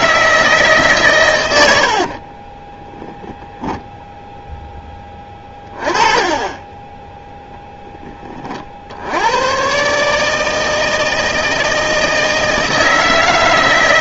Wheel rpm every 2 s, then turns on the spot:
150, 20, 10, 10, 50, 160, 160.
2-4